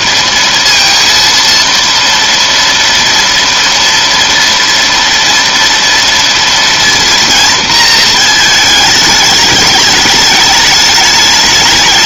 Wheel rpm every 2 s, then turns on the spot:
230, 230, 230, 230, 220, 210.
none